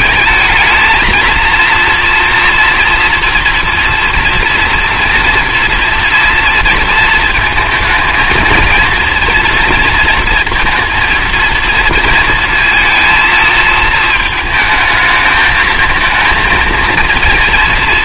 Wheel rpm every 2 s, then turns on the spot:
220, 230, 230, 230, 230, 230, 220, 220, 230.
none